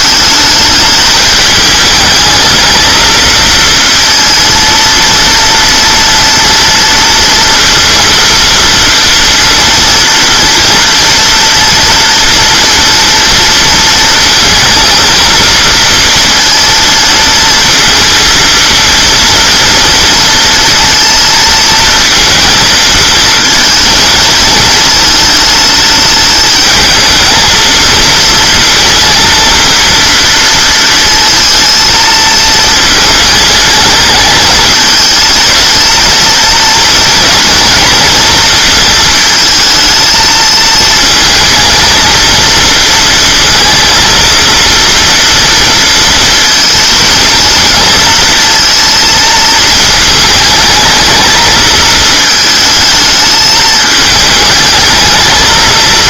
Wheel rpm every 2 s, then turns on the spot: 210, 220, 230, 230, 230, 240, 230, 230, 230, 230, 230, 220, 220, 220, 230, 230, 220, 220, 230, 220, 220, 230, 230, 230, 230, 220, 220, 220.
none